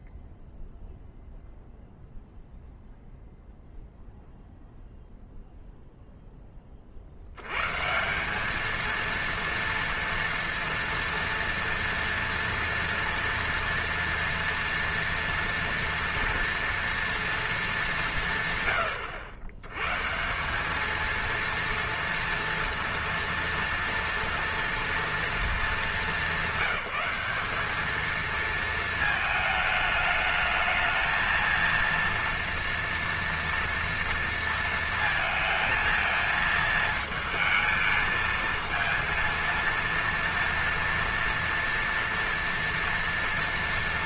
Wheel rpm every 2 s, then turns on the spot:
0, 0, 0, 50, 230, 230, 240, 230, 230, 110, 210, 240, 240, 200, 220, 220, 230, 230, 220, 220, 230, 230.
none